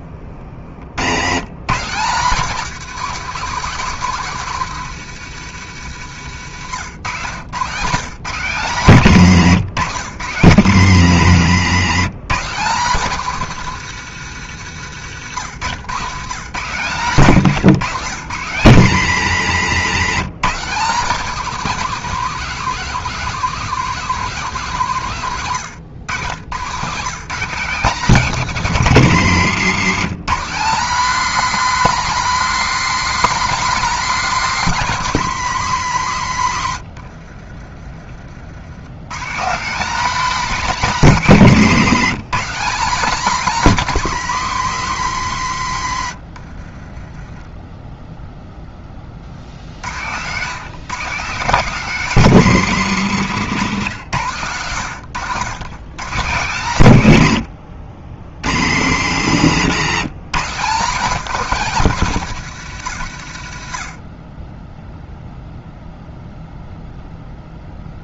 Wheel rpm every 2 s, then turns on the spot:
70, 210, 180, 120, 170, 150, 190, 130, 160, 140, 190, 230, 180, 160, 180, 250, 290, 240, 90, 120, 240, 240, 190, 20, 0, 160, 180, 100, 150, 120, 190, 120, 0, 0.
36-38